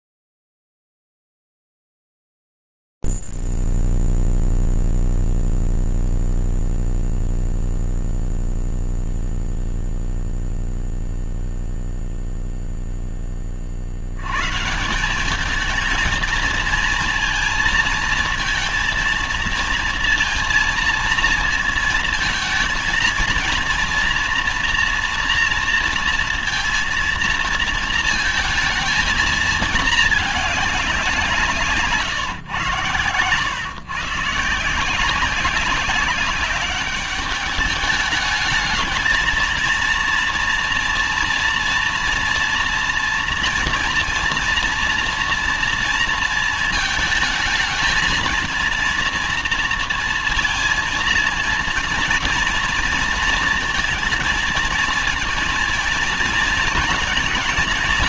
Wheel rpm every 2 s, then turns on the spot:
0, 0, 0, 0, 0, 0, 0, 70, 220, 230, 230, 220, 230, 230, 230, 220, 140, 140, 190, 210, 240, 230, 230, 230, 230, 230, 230, 230, 220.
none